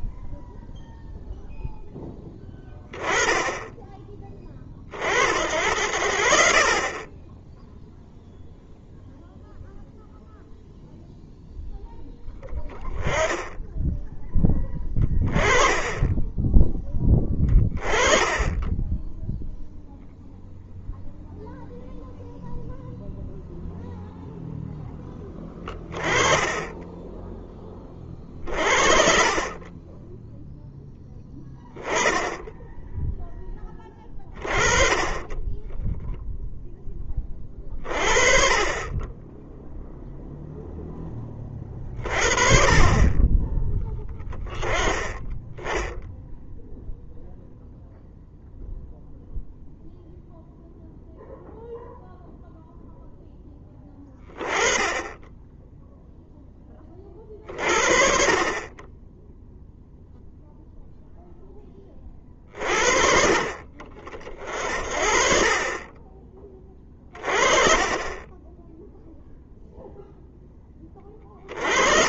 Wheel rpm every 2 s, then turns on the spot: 0, 10, 40, 40, 0, 0, 10, 10, 10, 10, 0, 0, 0, 10, 40, 10, 10, 30, 10, 20, 0, 30, 20, 0, 0, 0, 0, 20, 20, 20, 0, 50, 40, 30, 10, 20.
26-28 66-70